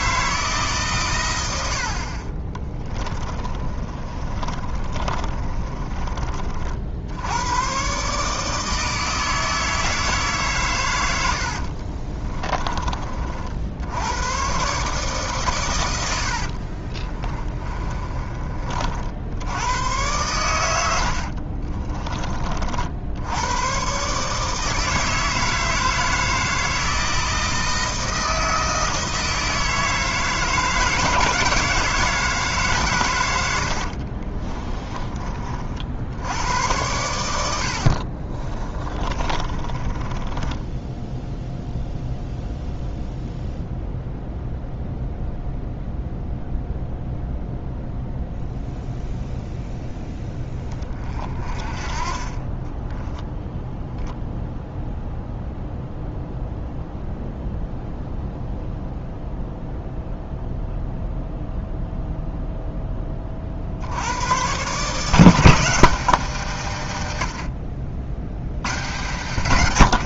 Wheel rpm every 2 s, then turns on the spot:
140, 20, 30, 50, 160, 120, 30, 140, 40, 50, 90, 50, 160, 160, 160, 160, 140, 30, 100, 30, 10, 0, 0, 0, 0, 20, 10, 0, 0, 0, 0, 10, 140, 140, 110.
2-6 16-18 20-22 34-36 38-42 52-54